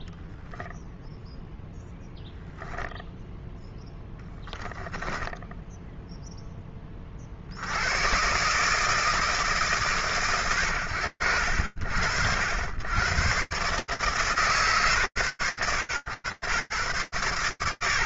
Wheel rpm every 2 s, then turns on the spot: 0, 10, 10, 70, 150, 70, 130, 110, 120.
none